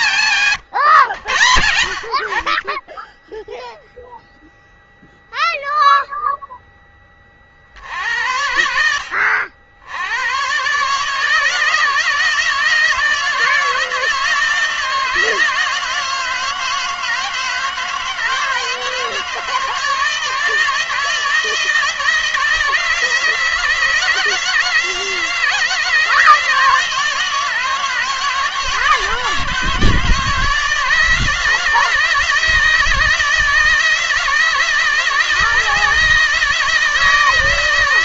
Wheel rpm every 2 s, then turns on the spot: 100, 50, 0, 0, 70, 110, 160, 160, 170, 160, 160, 160, 160, 170, 160, 160, 160, 160, 160.
none